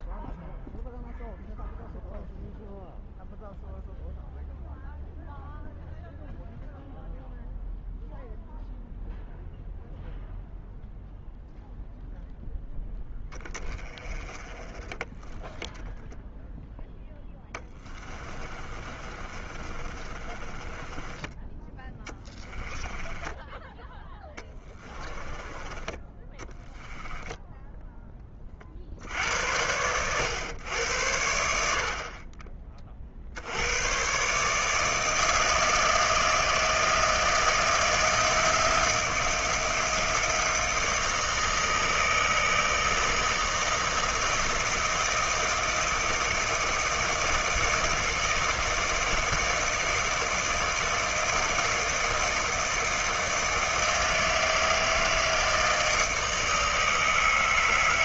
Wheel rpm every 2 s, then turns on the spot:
0, 0, 0, 0, 0, 0, 10, 20, 0, 30, 20, 10, 20, 10, 50, 100, 40, 150, 160, 170, 160, 160, 160, 160, 160, 160, 160, 160, 160.
18-28